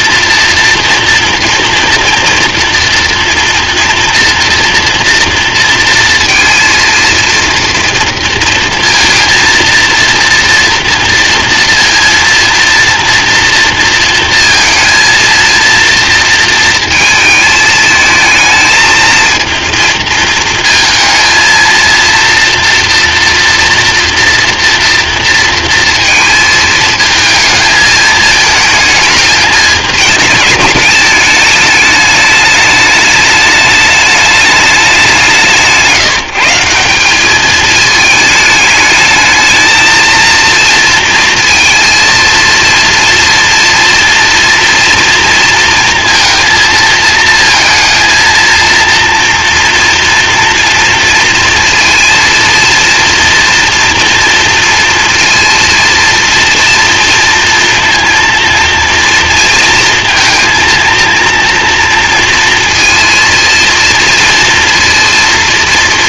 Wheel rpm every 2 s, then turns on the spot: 230, 230, 230, 230, 230, 230, 230, 230, 230, 220, 220, 230, 230, 220, 220, 210, 210, 200, 180, 220, 230, 230, 230, 230, 230, 230, 230, 230, 230, 230, 230, 230, 230.
none